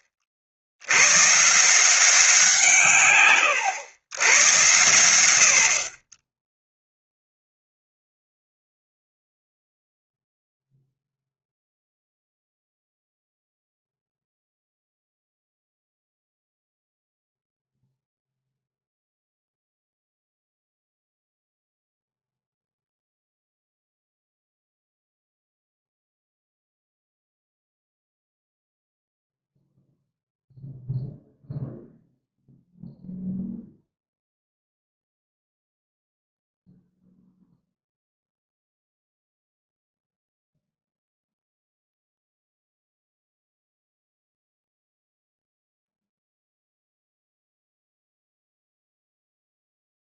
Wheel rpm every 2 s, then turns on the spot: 90, 140, 100, 0, 0, 0, 0, 0, 0, 0, 0, 0, 0, 0, 0, 0, 0, 0, 0, 0, 0, 0, 0, 0, 0.
none